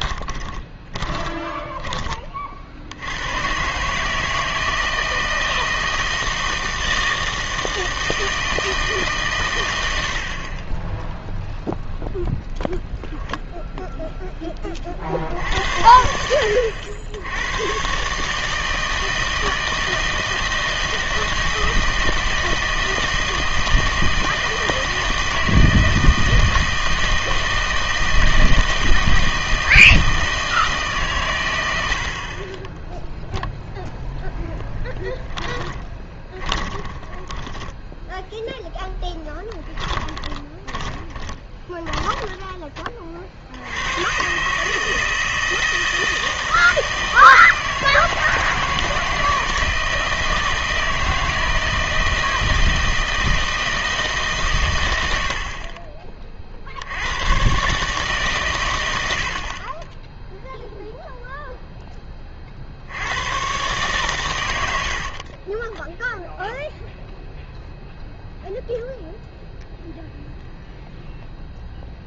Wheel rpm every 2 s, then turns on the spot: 20, 60, 160, 160, 160, 20, 0, 30, 80, 160, 160, 160, 160, 160, 160, 150, 10, 10, 20, 10, 20, 20, 150, 160, 160, 160, 160, 110, 60, 110, 0, 70, 80, 0, 0, 0.
0-2 34-38 40-42 64-66